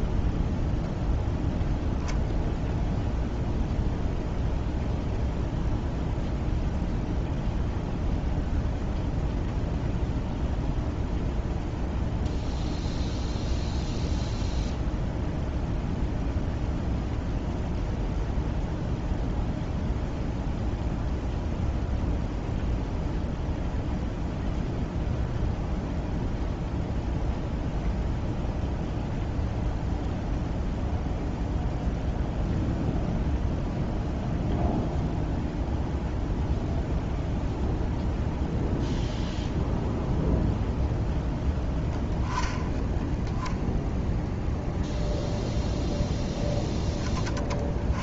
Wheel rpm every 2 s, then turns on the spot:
0, 0, 0, 0, 0, 0, 0, 0, 0, 0, 0, 0, 0, 0, 0, 0, 0, 0, 0, 0, 0, 10, 0, 10.
none